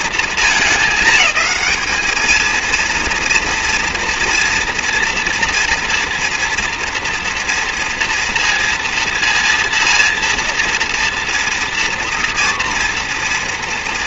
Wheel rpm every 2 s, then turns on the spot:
220, 230, 230, 230, 230, 230, 240.
none